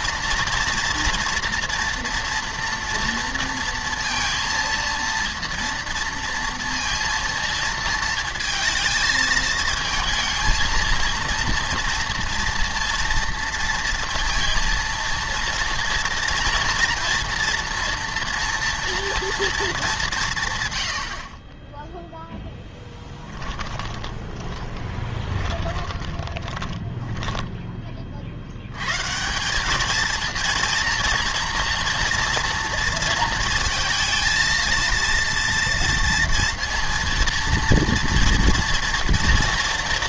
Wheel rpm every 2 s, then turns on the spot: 230, 230, 230, 230, 220, 230, 230, 230, 230, 230, 110, 10, 20, 20, 100, 230, 230, 230, 230, 240.
22-28